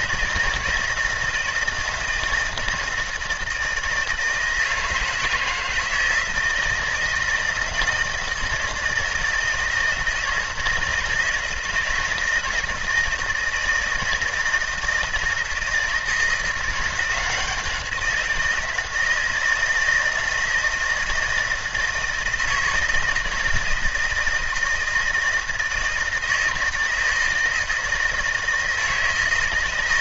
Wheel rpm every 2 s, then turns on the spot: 160, 160, 160, 160, 160, 160, 160, 160, 170, 160, 170, 160, 160, 160, 160.
none